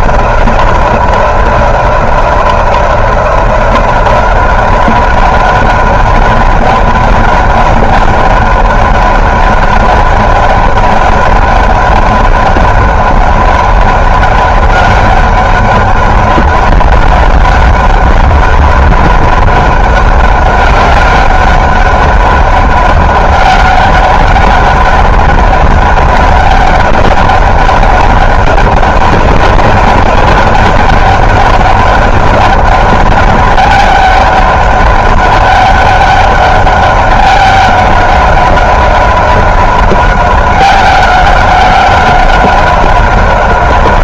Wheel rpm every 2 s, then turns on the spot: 180, 180, 190, 200, 200, 200, 190, 200, 200, 200, 200, 190, 200, 200, 190, 190, 200, 190, 200, 190, 190, 190.
none